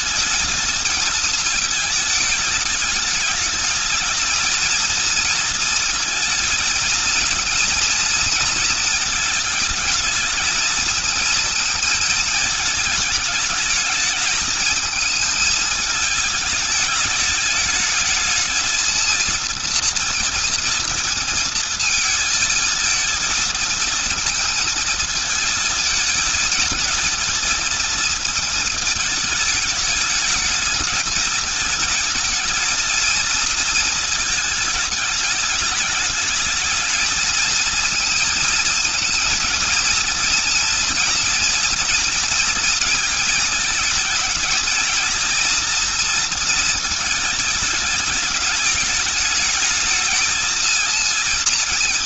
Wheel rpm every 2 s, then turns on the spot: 220, 210, 220, 230, 220, 220, 220, 220, 210, 220, 230, 230, 230, 230, 230, 220, 220, 220, 220, 220, 230, 220, 210, 230, 210, 220.
none